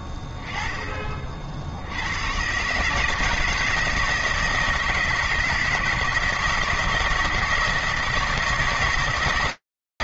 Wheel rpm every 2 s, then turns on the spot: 20, 140, 160, 160, 160.
none